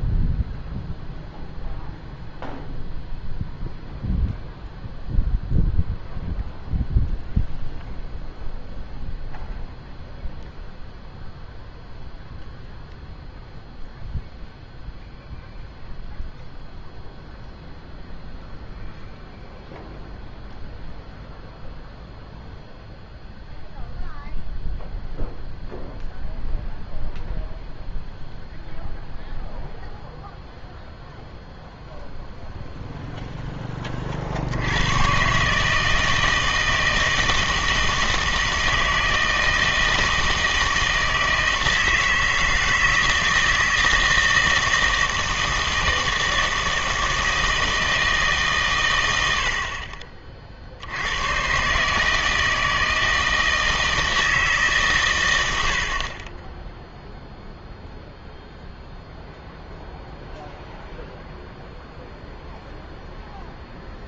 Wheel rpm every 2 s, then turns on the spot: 0, 0, 0, 0, 0, 0, 0, 0, 0, 0, 0, 0, 0, 0, 0, 0, 0, 80, 160, 160, 160, 160, 160, 160, 120, 60, 160, 150, 10, 0, 0, 0.
none